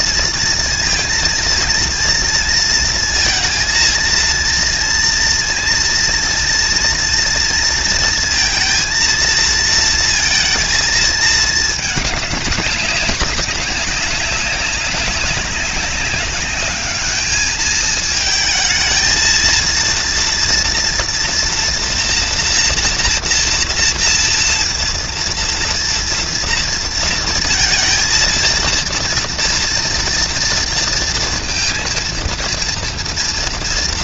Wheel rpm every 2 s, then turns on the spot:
230, 230, 230, 230, 230, 220, 200, 200, 210, 220, 230, 230, 230, 230, 230, 230, 230.
none